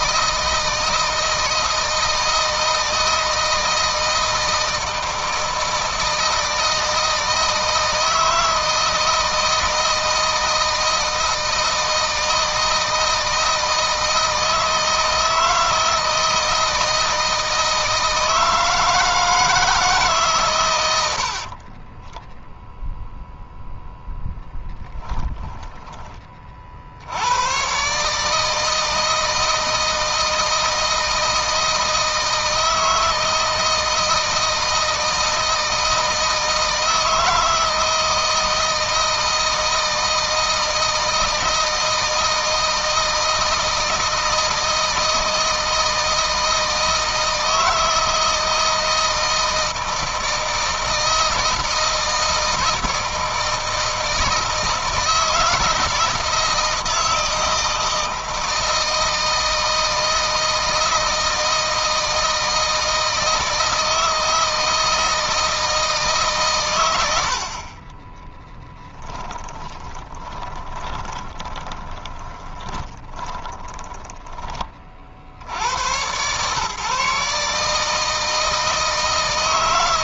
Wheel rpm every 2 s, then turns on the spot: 160, 160, 160, 160, 160, 160, 160, 160, 160, 160, 120, 0, 10, 50, 160, 160, 160, 160, 160, 160, 160, 160, 160, 160, 160, 160, 160, 160, 160, 160, 160, 160, 160, 110, 10, 20, 20, 20, 130, 160.
24-26 68-74